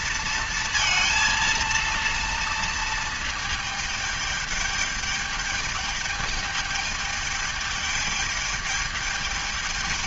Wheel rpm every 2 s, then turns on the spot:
230, 230, 210, 210, 210.
none